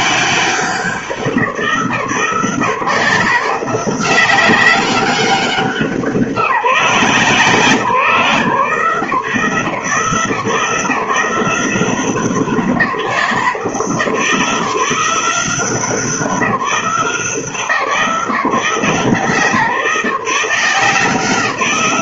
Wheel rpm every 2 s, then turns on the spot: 180, 160, 190, 160, 160, 160, 180, 170, 170, 160, 160.
none